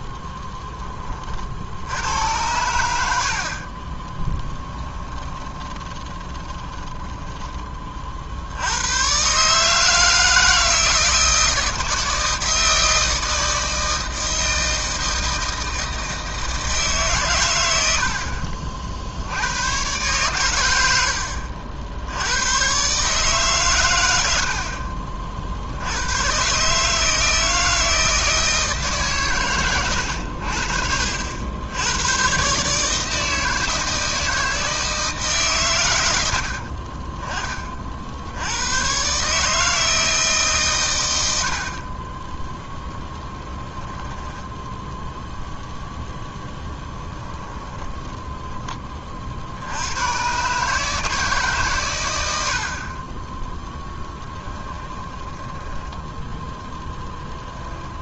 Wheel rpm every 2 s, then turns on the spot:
10, 100, 10, 20, 70, 160, 160, 160, 160, 50, 100, 110, 60, 140, 160, 70, 140, 160, 70, 120, 140, 0, 10, 10, 40, 140, 60, 10, 10.
4-8 46-50 54-56